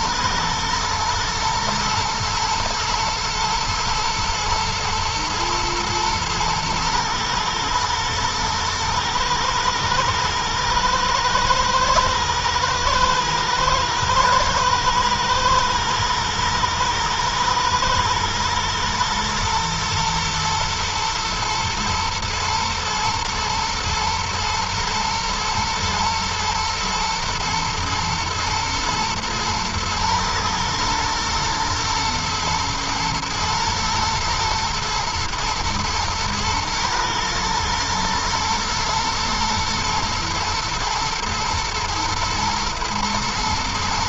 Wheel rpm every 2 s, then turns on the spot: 110, 110, 110, 110, 110, 110, 110, 110, 120, 120, 120, 120, 110, 120, 120, 110, 110, 110, 110, 110, 120, 110.
none